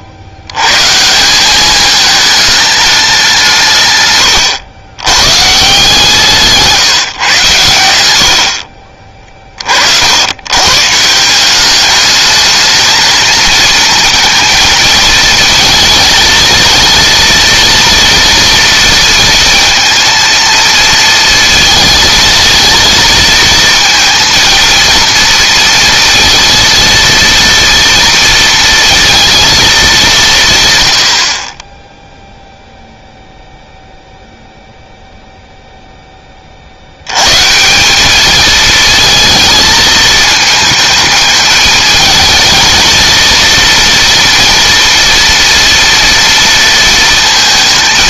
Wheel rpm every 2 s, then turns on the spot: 110, 210, 100, 170, 50, 140, 220, 230, 230, 230, 230, 230, 230, 230, 230, 120, 0, 0, 50, 220, 220, 220, 230, 230.
none